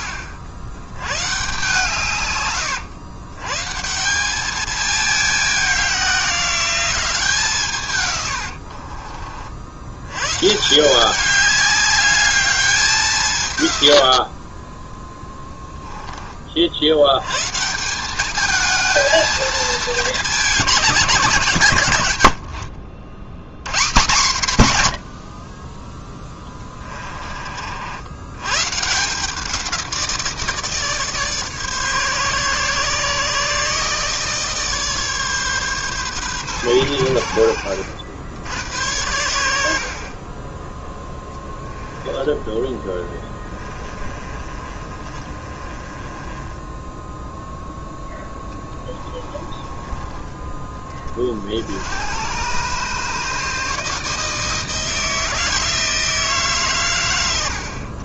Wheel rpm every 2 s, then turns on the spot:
100, 120, 210, 190, 80, 160, 200, 20, 60, 220, 200, 70, 130, 20, 120, 160, 140, 150, 120, 90, 10, 10, 30, 10, 20, 20, 130, 160, 140.
8-10 14-16 26-28 42-50